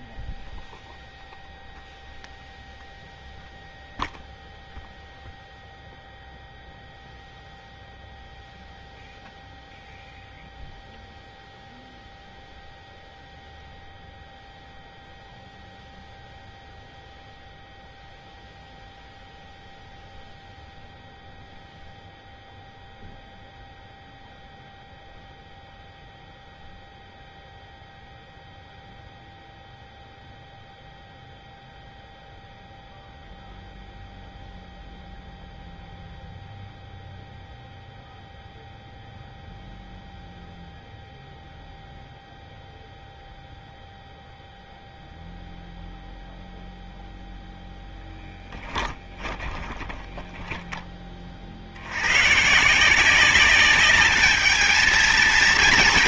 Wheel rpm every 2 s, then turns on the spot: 0, 0, 0, 0, 0, 0, 0, 0, 0, 0, 0, 0, 0, 0, 0, 0, 0, 0, 0, 0, 0, 0, 0, 0, 10, 20, 120, 210.
48-50